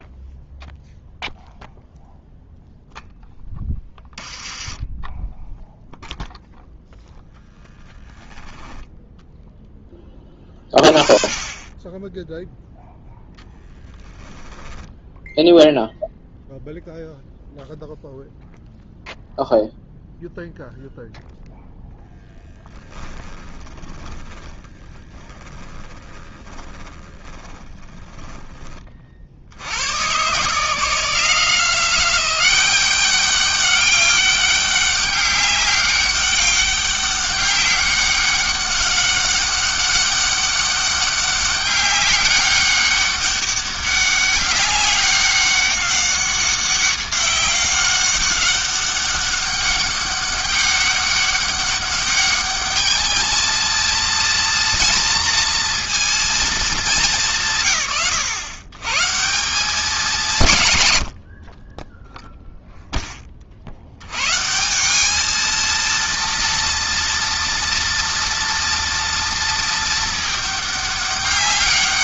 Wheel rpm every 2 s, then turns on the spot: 0, 0, 10, 10, 10, 20, 0, 10, 0, 0, 0, 10, 20, 20, 40, 160, 200, 200, 200, 200, 200, 200, 200, 190, 200, 200, 210, 230, 210, 130, 80, 10, 180, 230, 230, 210.
4-6 22-28